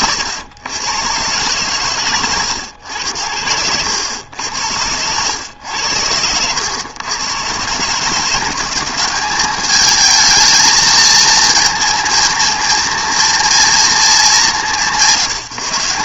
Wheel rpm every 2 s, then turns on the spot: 120, 80, 90, 120, 180, 220, 230, 170.
4-6